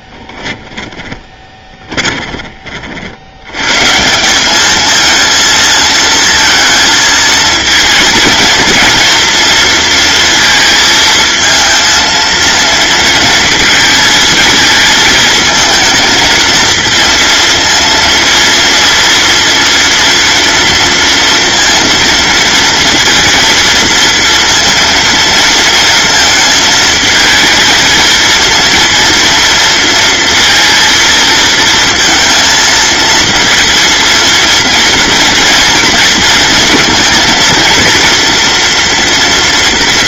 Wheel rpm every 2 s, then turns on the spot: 10, 40, 210, 220, 230, 220, 230, 220, 220, 230, 230, 230, 230, 220, 230, 230, 230, 230, 230, 240.
0-2